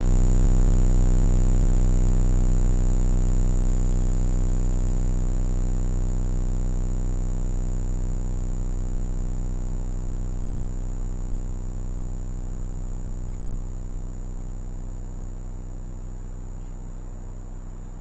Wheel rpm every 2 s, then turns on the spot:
0, 0, 0, 0, 0, 0, 0, 0, 0.
none